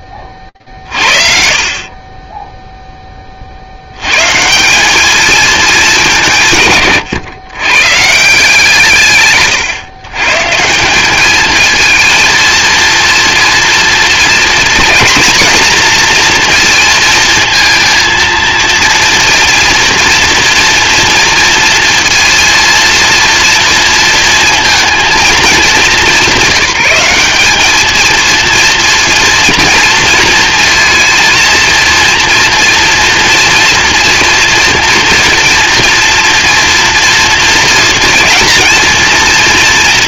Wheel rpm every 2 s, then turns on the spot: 40, 10, 200, 140, 150, 200, 230, 230, 230, 230, 230, 230, 230, 200, 230, 230, 230, 230, 230, 230.
none